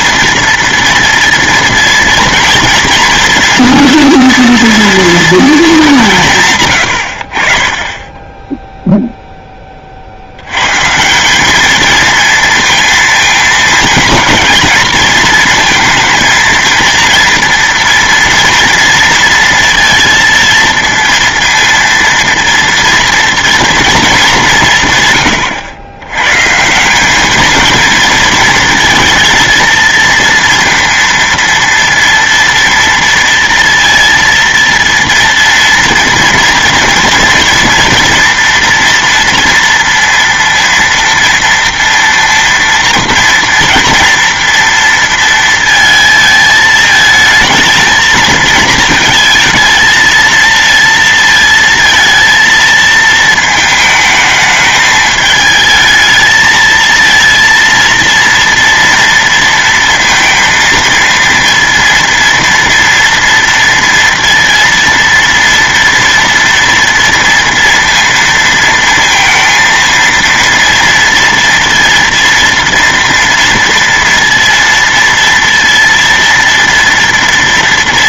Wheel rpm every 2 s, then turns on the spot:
230, 230, 230, 130, 10, 120, 230, 230, 230, 230, 230, 230, 170, 150, 230, 230, 230, 230, 230, 230, 230, 230, 230, 220, 220, 230, 230, 220, 220, 230, 230, 230, 230, 230, 230, 230, 230, 230, 230.
none